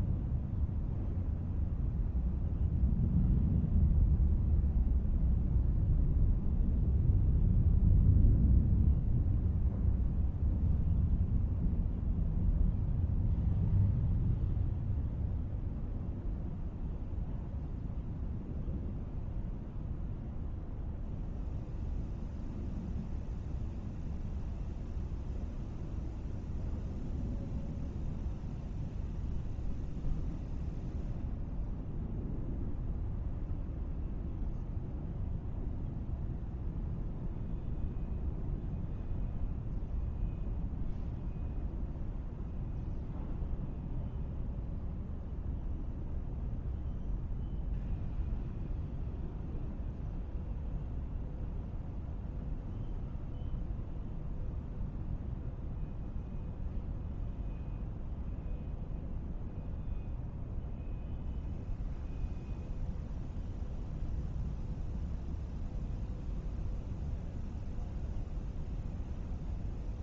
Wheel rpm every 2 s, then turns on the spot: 0, 0, 0, 0, 0, 0, 0, 0, 0, 0, 0, 0, 0, 0, 0, 0, 0, 0, 0, 0, 0, 0, 0, 0, 0, 0, 0, 0, 0, 0, 0, 0, 0, 0, 0.
none